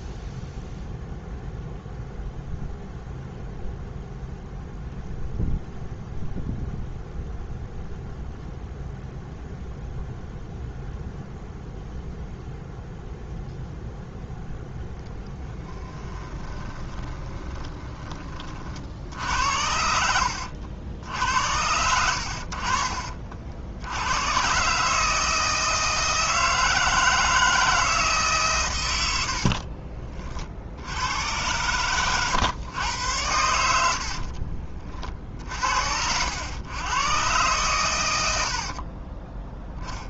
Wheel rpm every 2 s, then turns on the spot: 0, 0, 0, 0, 0, 0, 0, 0, 20, 20, 80, 80, 80, 160, 160, 40, 110, 80, 70, 110.
16-20 30-32 34-36